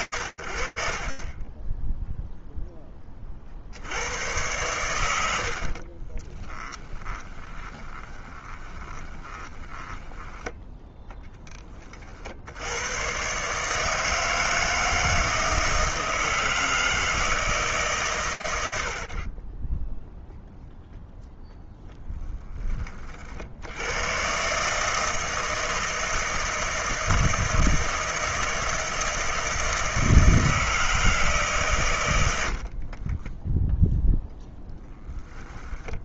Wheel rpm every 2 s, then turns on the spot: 70, 10, 110, 20, 20, 10, 130, 160, 160, 50, 0, 50, 160, 160, 160, 130, 10, 10.
4-10 32-36